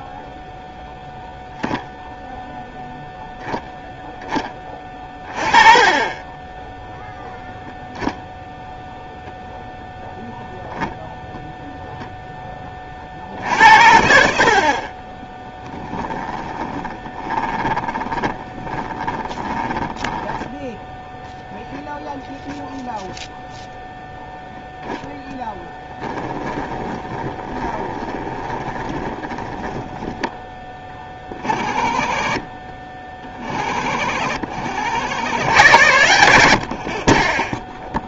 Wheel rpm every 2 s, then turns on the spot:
0, 0, 10, 10, 0, 0, 20, 60, 20, 20, 10, 0, 0, 20, 20, 10, 40, 60, 70.
16-20 26-30